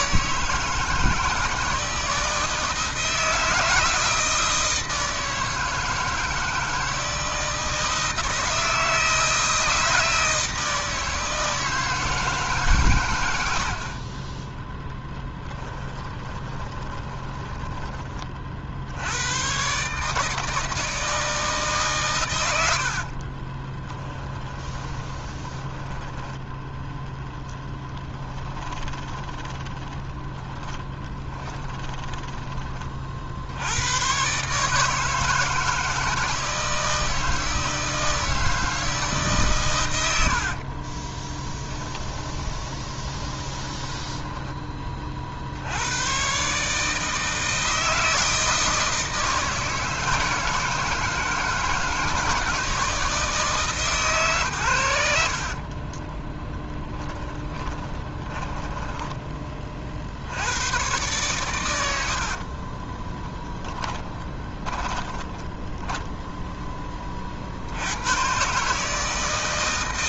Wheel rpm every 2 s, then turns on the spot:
160, 160, 160, 160, 160, 160, 120, 20, 20, 70, 160, 70, 20, 0, 20, 20, 40, 150, 160, 160, 30, 20, 30, 150, 160, 160, 160, 100, 10, 10, 110, 30, 10, 20, 160.
14-18 22-26 28-32 40-44 56-60 62-66